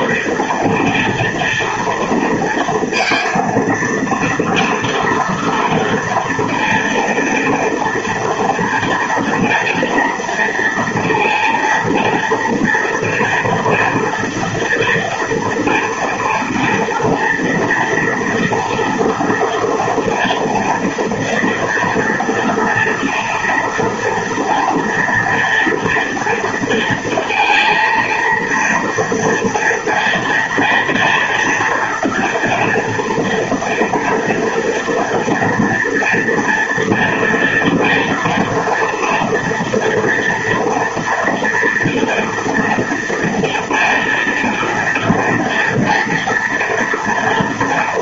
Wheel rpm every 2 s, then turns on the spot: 230, 230, 230, 230, 230, 240, 240, 230, 230, 230, 230, 230, 230, 230, 230, 230, 240, 230, 240, 230, 230, 230, 240, 230.
none